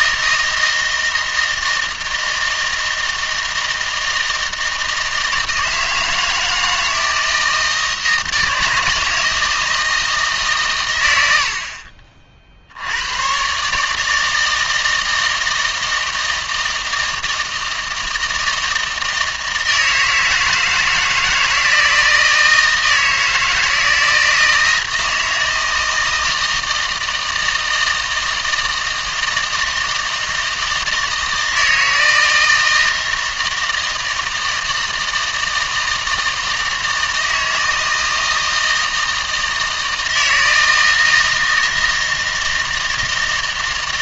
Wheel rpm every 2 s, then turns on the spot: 160, 160, 160, 160, 160, 130, 70, 160, 160, 160, 160, 160, 160, 160, 160, 160, 160, 160, 160, 160, 160, 160.
none